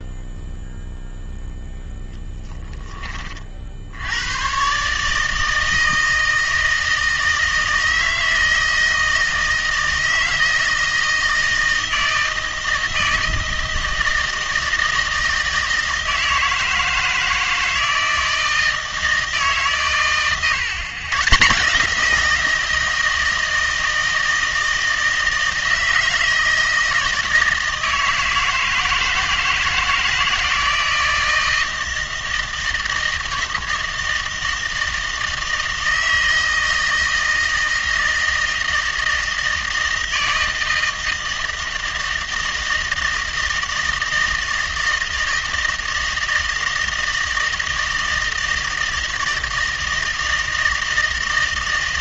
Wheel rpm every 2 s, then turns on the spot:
0, 10, 130, 160, 160, 160, 160, 160, 160, 160, 120, 170, 160, 160, 160, 160, 160, 160, 160, 160, 160, 160, 160, 160, 160, 160.
none